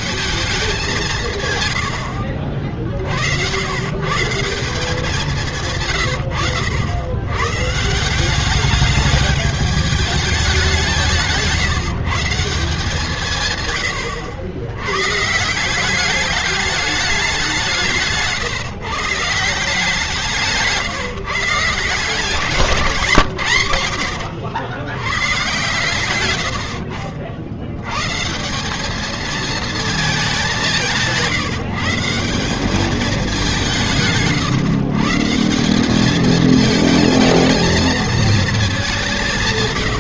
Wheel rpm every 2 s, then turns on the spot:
140, 70, 180, 120, 200, 170, 130, 120, 190, 140, 150, 160, 110, 70, 190, 190, 190, 130, 220, 190.
none